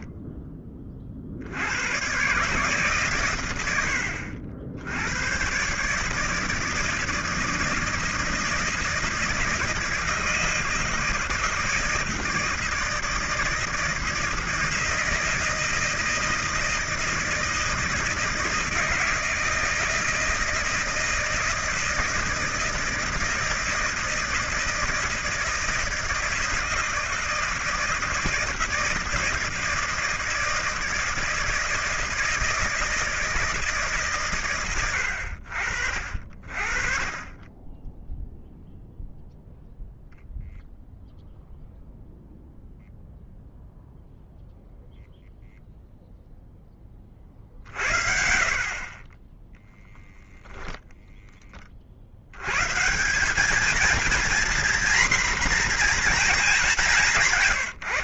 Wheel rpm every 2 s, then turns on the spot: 20, 150, 80, 160, 160, 160, 160, 160, 160, 160, 160, 160, 160, 160, 160, 160, 160, 100, 30, 0, 0, 0, 0, 20, 40, 0, 150, 240, 190.
none